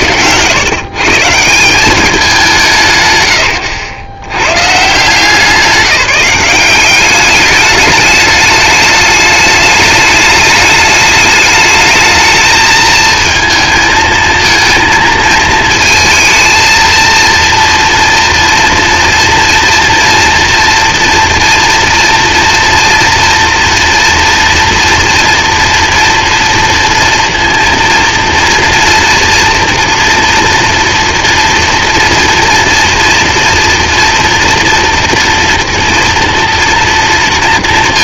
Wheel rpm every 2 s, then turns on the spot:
110, 150, 120, 190, 210, 210, 220, 230, 230, 240, 230, 230, 230, 230, 230, 240, 230, 230, 230.
none